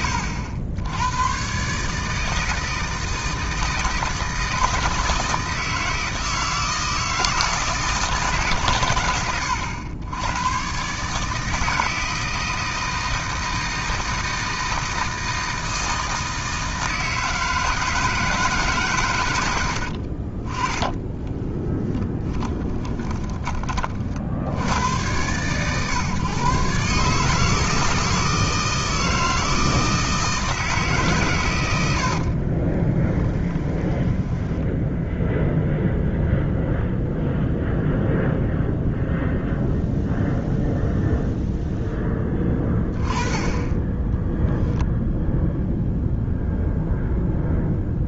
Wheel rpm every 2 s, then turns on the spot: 100, 160, 160, 160, 120, 130, 160, 160, 160, 140, 20, 20, 100, 140, 160, 160, 30, 10, 0, 0, 0, 20, 0, 0.
20-24 32-34